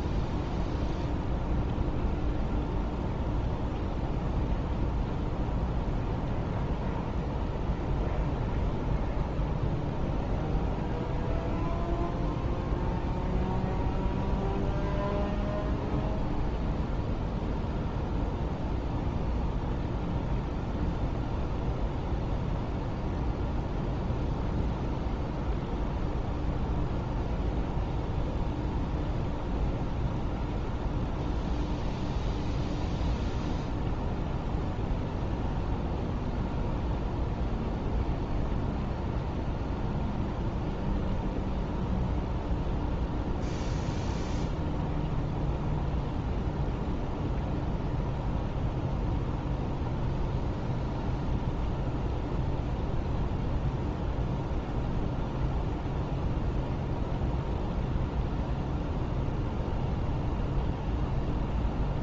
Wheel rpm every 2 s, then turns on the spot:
0, 0, 0, 0, 0, 0, 0, 0, 0, 0, 0, 0, 0, 0, 0, 0, 0, 0, 0, 0, 0, 0, 0, 0, 0, 0, 0, 0, 0, 0, 0.
none